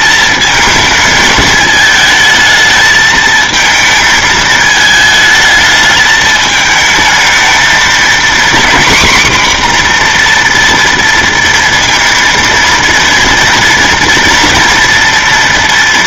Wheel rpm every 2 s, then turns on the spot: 220, 220, 220, 220, 250, 240, 230, 230.
none